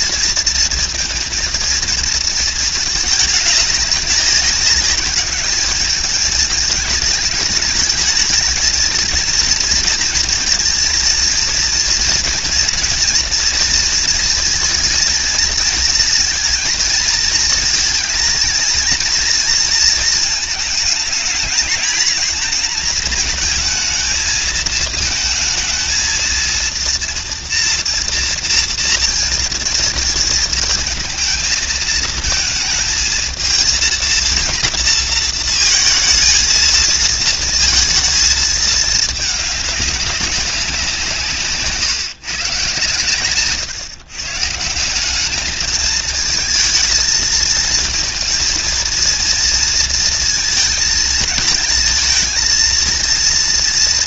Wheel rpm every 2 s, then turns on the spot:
230, 220, 210, 220, 220, 230, 230, 230, 230, 230, 220, 230, 220, 230, 230, 230, 220, 230, 230, 220, 180, 130, 180, 220, 230, 220, 230.
none